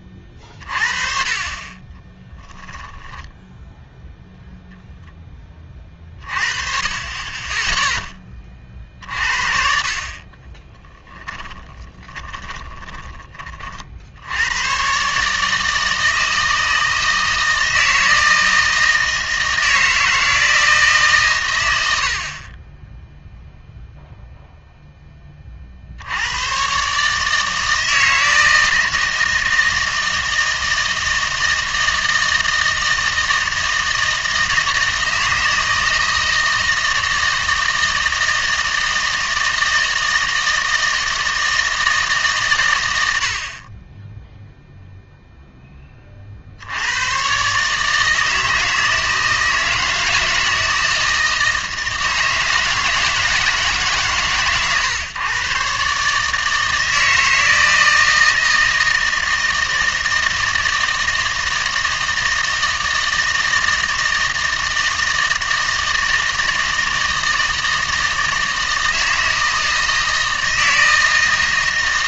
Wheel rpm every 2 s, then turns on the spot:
30, 10, 0, 40, 30, 20, 20, 100, 160, 160, 160, 20, 0, 120, 160, 160, 160, 160, 160, 160, 160, 120, 0, 70, 160, 160, 160, 130, 160, 160, 160, 160, 160, 160, 160, 160.
2-4 10-14